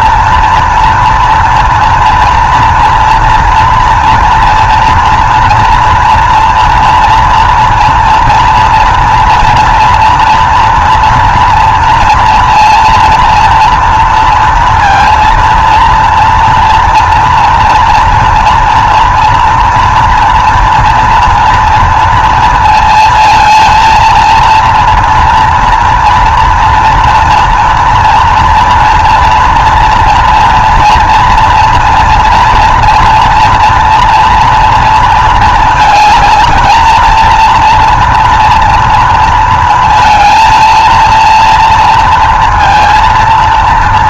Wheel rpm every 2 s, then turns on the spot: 230, 230, 240, 240, 230, 230, 230, 230, 230, 230, 230, 230, 230, 230, 230, 230, 240, 230, 230, 230, 230, 230.
none